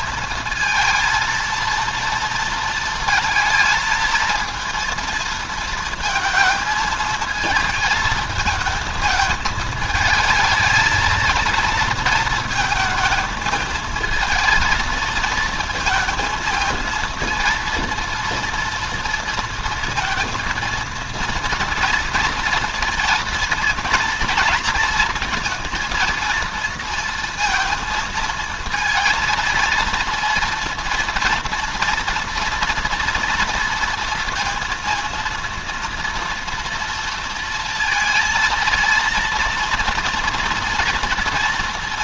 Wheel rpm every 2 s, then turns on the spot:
230, 230, 230, 220, 220, 220, 220, 230, 220, 230, 220, 230, 230, 230, 230, 230, 230, 230, 230, 230, 230.
none